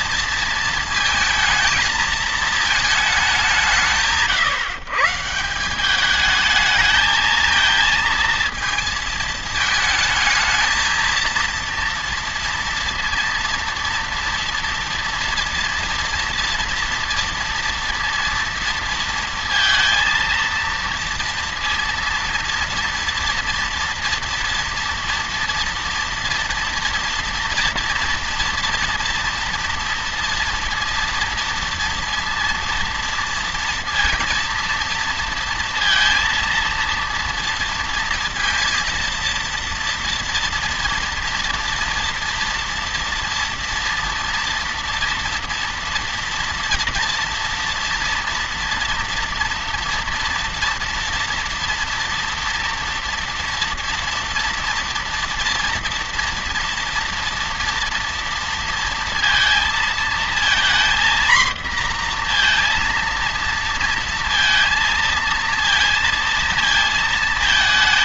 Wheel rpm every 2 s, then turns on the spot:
230, 220, 150, 220, 230, 230, 230, 230, 230, 230, 230, 230, 230, 230, 230, 230, 230, 230, 230, 230, 230, 240, 240, 230, 230, 240, 230, 230, 230, 230, 230, 230, 230, 220.
none